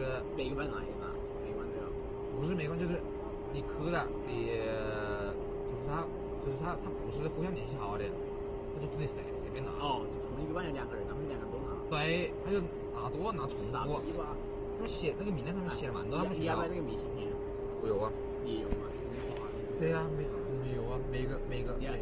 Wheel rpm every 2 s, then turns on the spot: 0, 0, 0, 0, 0, 0, 0, 0, 0, 0, 0.
none